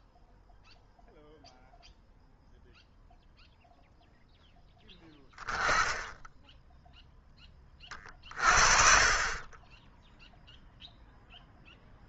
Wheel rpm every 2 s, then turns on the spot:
0, 0, 10, 0, 30, 0.
none